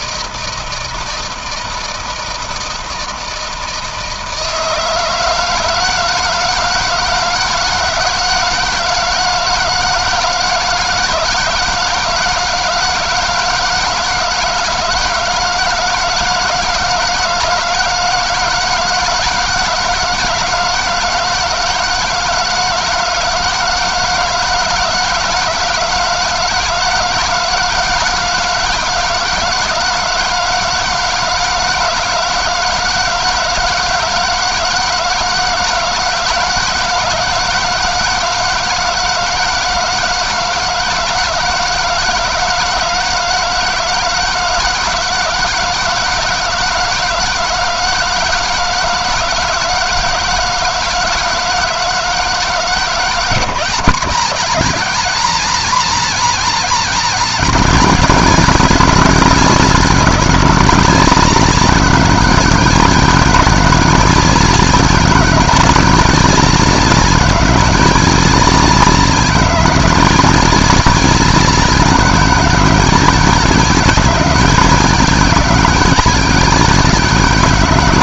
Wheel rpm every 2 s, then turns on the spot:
160, 160, 160, 160, 160, 160, 160, 170, 160, 160, 160, 160, 160, 160, 160, 160, 160, 160, 160, 160, 160, 160, 160, 160, 160, 160, 160, 180, 190, 190, 190, 180, 190, 190, 190, 190, 190, 190, 190.
none